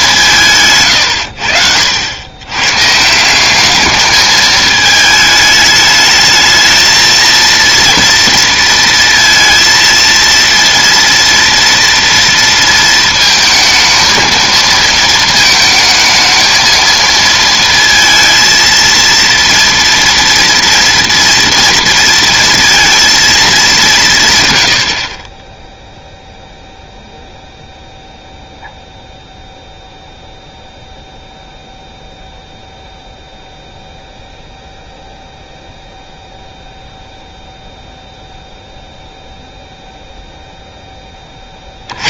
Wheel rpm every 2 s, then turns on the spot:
140, 130, 220, 220, 230, 230, 230, 230, 220, 230, 230, 230, 90, 0, 0, 0, 0, 0, 0, 0, 10.
none